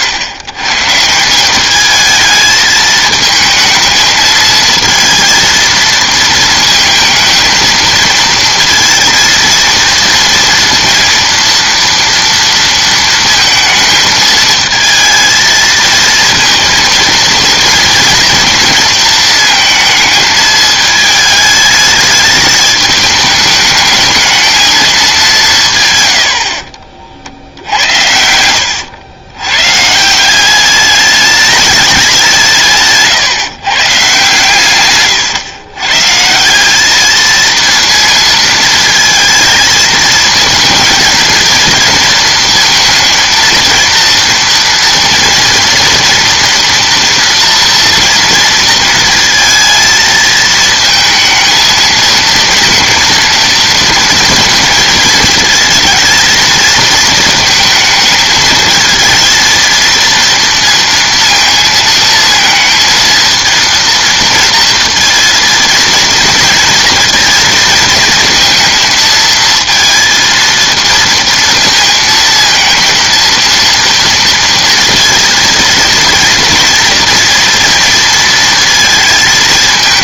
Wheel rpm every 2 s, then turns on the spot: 120, 220, 220, 230, 230, 230, 230, 220, 230, 230, 210, 210, 220, 60, 80, 190, 160, 140, 180, 230, 230, 230, 230, 230, 230, 220, 230, 230, 230, 220, 230, 230, 230, 230, 230, 230, 230, 240, 230, 230.
26-30